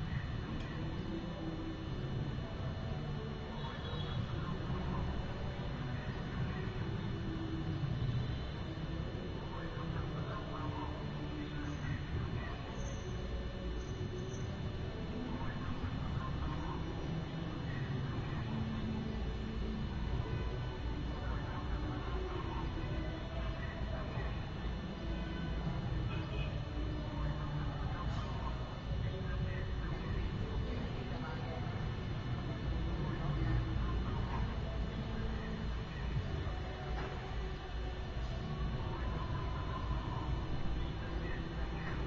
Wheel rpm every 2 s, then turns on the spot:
0, 0, 0, 0, 0, 0, 0, 0, 0, 0, 0, 0, 0, 0, 0, 0, 0, 0, 0, 0, 0.
none